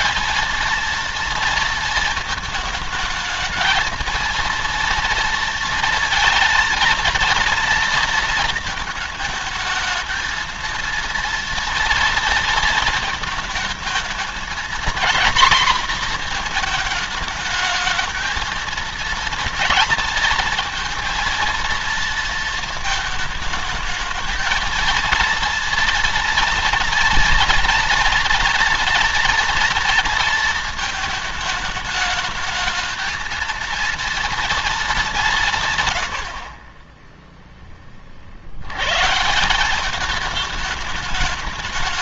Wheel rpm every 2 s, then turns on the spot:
230, 220, 230, 230, 220, 230, 230, 230, 230, 230, 230, 230, 220, 230, 240, 230, 220, 230, 50, 70, 210.
none